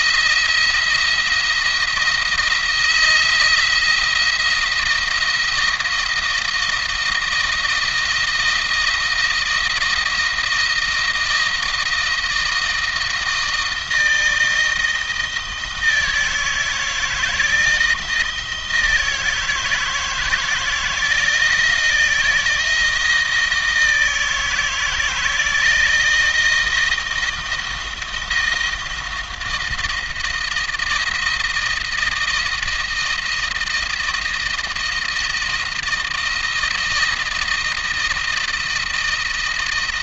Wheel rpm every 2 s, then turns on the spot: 170, 170, 170, 160, 160, 160, 160, 160, 160, 160, 160, 160, 160, 170, 160, 160, 160, 160, 170, 170.
none